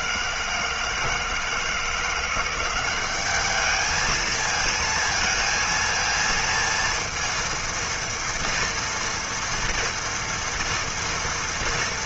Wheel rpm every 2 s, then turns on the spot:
160, 190, 220, 230, 240, 230.
none